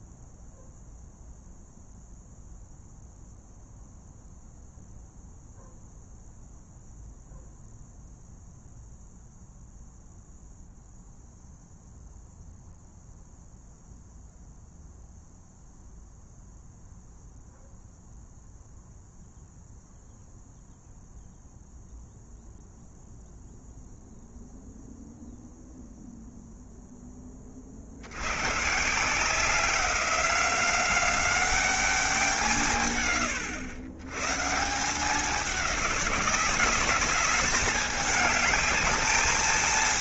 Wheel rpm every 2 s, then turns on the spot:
0, 0, 0, 0, 0, 0, 0, 0, 0, 0, 0, 0, 0, 0, 140, 190, 140, 160, 190, 210.
none